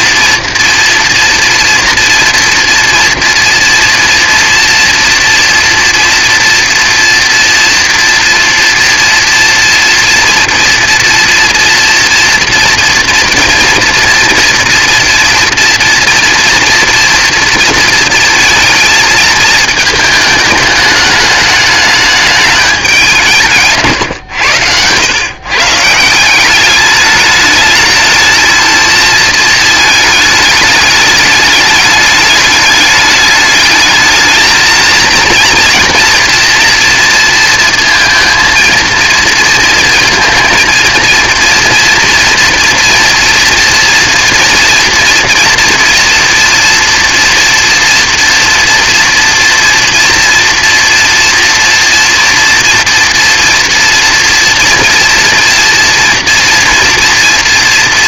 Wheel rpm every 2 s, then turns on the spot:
230, 230, 230, 230, 230, 230, 230, 230, 230, 220, 210, 210, 100, 200, 220, 210, 210, 220, 240, 230, 230, 230, 230, 230, 230, 240, 230, 240, 230.
none